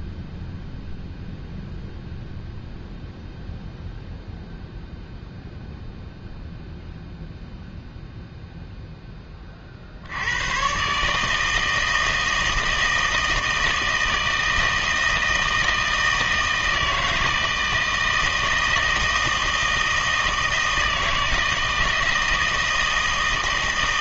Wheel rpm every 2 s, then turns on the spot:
0, 0, 0, 0, 0, 120, 160, 160, 160, 160, 160, 160.
none